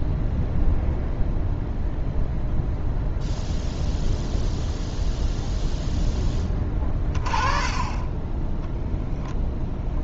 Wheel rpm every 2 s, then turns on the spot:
0, 0, 0, 20, 0.
none